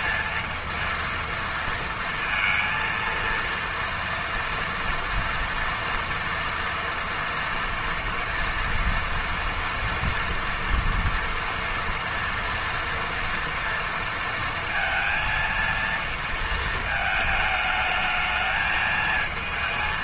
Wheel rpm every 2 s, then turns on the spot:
230, 230, 230, 230, 230, 240, 230, 230, 220, 220.
none